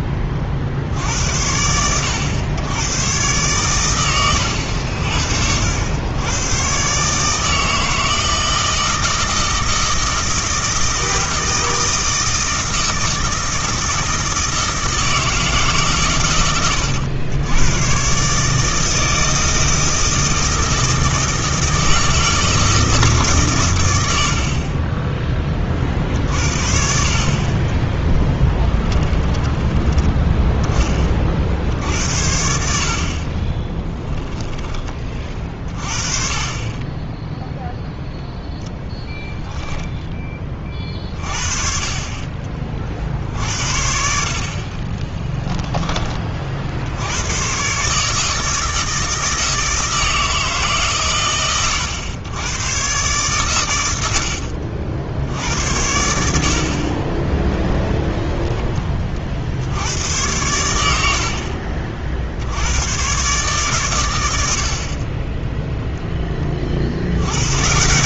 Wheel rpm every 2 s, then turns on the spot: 50, 100, 90, 130, 160, 160, 160, 160, 110, 150, 160, 160, 40, 60, 20, 10, 60, 20, 30, 0, 40, 40, 50, 50, 160, 150, 110, 60, 60, 10, 90, 90, 60, 40.
28-30 44-46